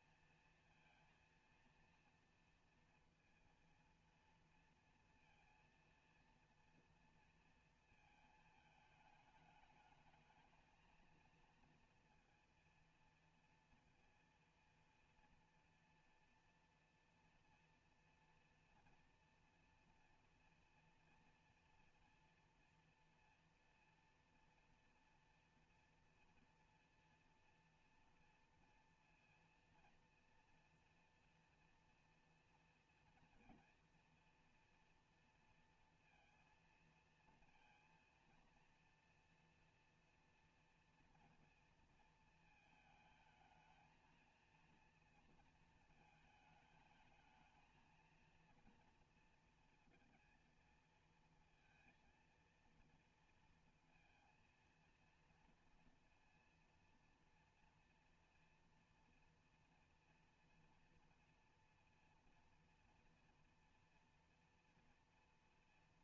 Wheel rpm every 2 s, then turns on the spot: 230, 230, 230, 230, 220, 220, 230, 230, 240, 230, 230, 230, 230, 240, 240, 230, 230, 230, 230, 230, 230, 220, 230, 220, 230, 230, 230, 230, 230, 230, 230, 230, 240.
none